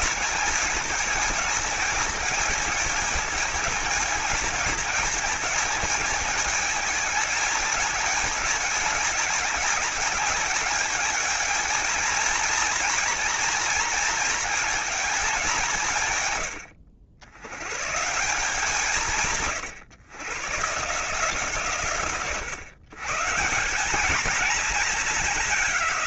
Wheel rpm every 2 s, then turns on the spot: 220, 220, 220, 220, 220, 220, 220, 220, 90, 170, 140, 130, 220.
none